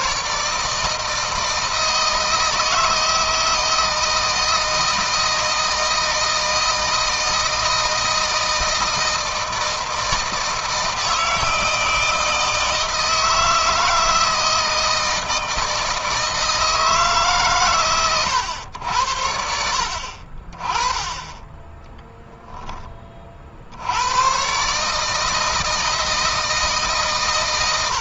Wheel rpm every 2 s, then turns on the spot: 150, 160, 160, 160, 160, 160, 160, 160, 150, 90, 40, 10, 130, 160.
none